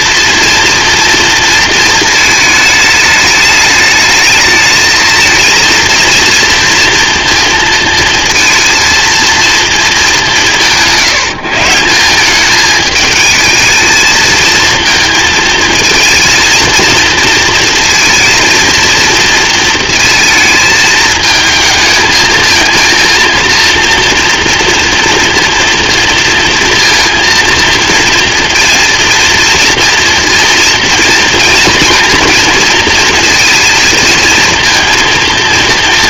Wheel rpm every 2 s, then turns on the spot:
230, 220, 220, 230, 230, 170, 210, 220, 230, 230, 220, 230, 240, 230, 230, 230, 230, 230.
none